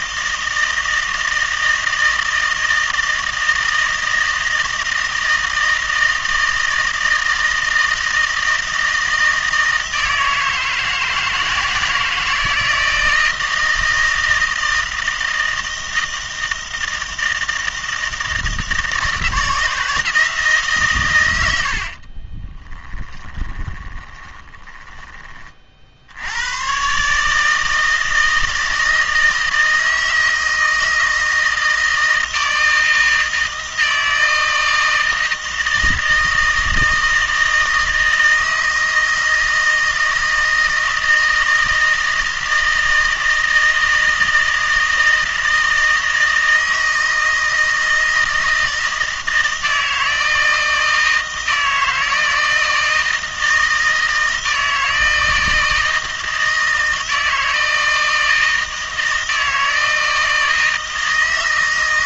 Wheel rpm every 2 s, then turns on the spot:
160, 160, 160, 160, 160, 160, 160, 160, 160, 160, 140, 20, 20, 120, 160, 160, 160, 160, 160, 160, 160, 160, 160, 160, 160, 160, 160, 160, 160, 160, 160.
22-26